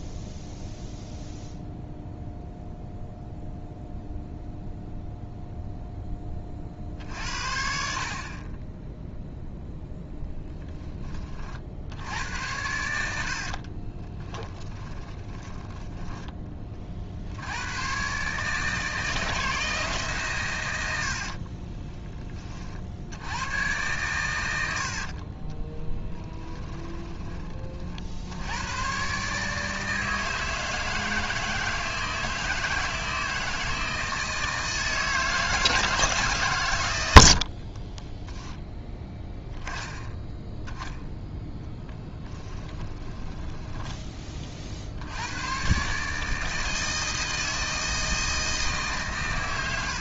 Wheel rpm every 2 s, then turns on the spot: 0, 0, 0, 40, 20, 10, 80, 20, 30, 150, 90, 50, 80, 20, 110, 160, 160, 160, 130, 10, 10, 10, 60, 160, 150.
14-16 26-28 42-44